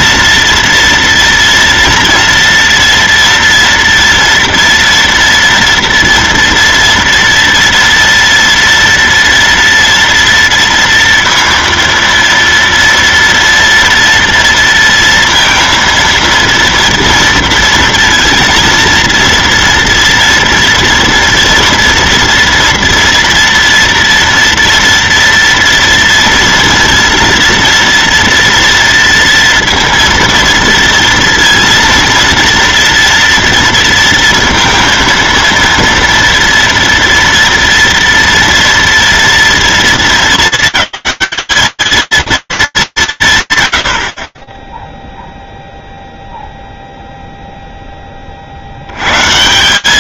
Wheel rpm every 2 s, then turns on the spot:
240, 230, 230, 230, 230, 230, 230, 230, 230, 230, 230, 230, 230, 230, 240, 230, 230, 230, 230, 240, 210, 230, 50, 0, 40.
none